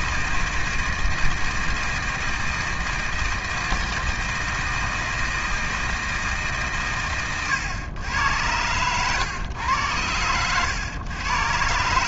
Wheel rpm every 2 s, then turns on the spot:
160, 160, 160, 120, 100, 120.
none